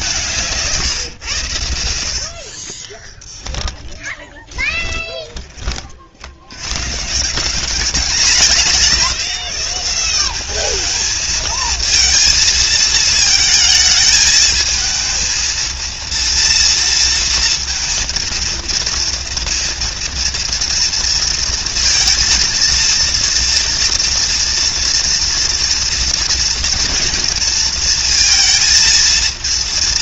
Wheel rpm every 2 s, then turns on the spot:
140, 20, 20, 110, 180, 210, 220, 220, 230, 230, 230, 230, 230, 230, 230.
2-6